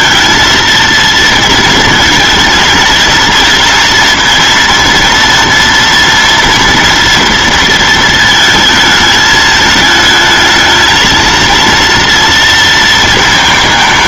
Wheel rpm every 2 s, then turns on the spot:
230, 220, 230, 230, 220, 220, 230.
none